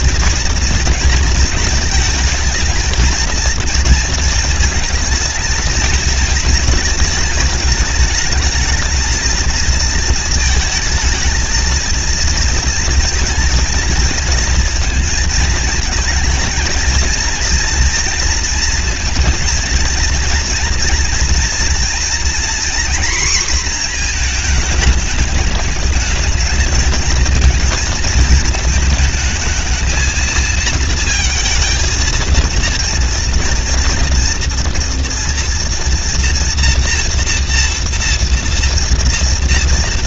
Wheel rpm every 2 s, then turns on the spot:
230, 220, 230, 220, 220, 220, 230, 230, 230, 230, 230, 230, 220, 210, 220, 230, 230, 230, 230, 230.
none